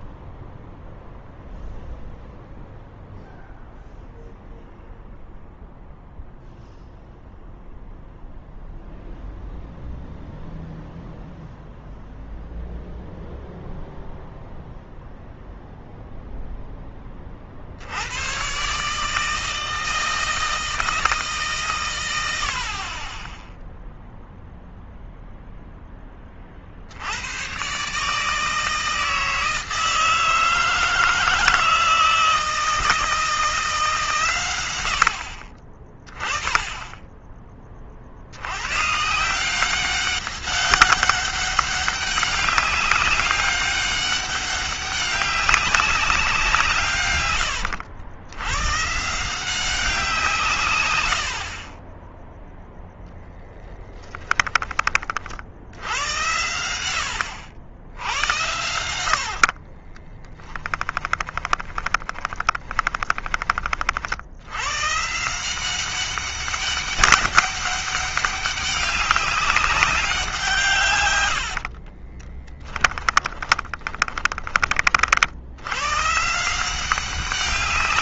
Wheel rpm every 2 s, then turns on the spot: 0, 0, 0, 0, 0, 0, 0, 0, 10, 140, 160, 40, 0, 60, 160, 160, 160, 90, 20, 130, 200, 200, 190, 150, 140, 130, 0, 20, 80, 80, 20, 10, 120, 200, 200, 140, 10, 40, 180.
58-64 72-74